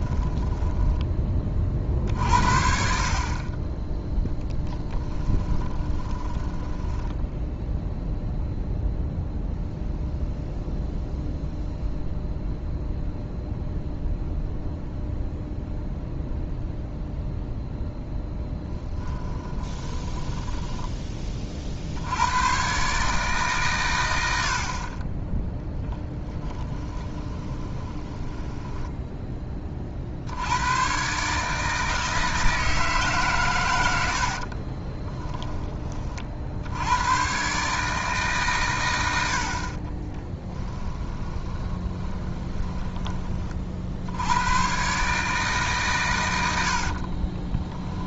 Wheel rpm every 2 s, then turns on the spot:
10, 40, 10, 10, 0, 0, 0, 0, 0, 10, 10, 130, 40, 20, 10, 110, 160, 30, 90, 110, 10, 20, 130, 50.
0-2 4-8 18-20 26-30 34-36 40-44 46-48